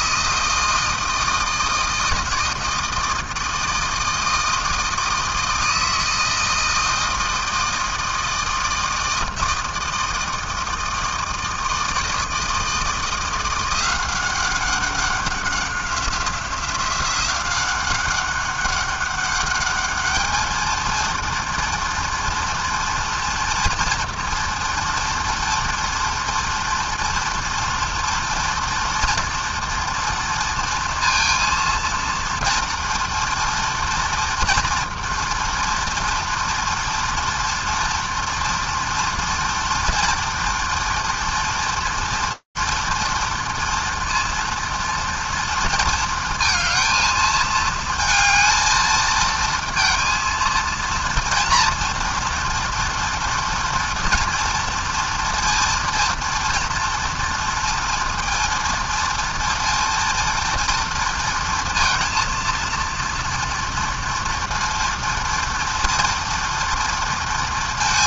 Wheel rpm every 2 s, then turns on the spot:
160, 160, 160, 160, 160, 160, 160, 190, 180, 200, 220, 240, 230, 230, 230, 230, 230, 240, 230, 230, 230, 230, 230, 220, 220, 230, 230, 240, 240, 230, 230, 230, 230, 230.
none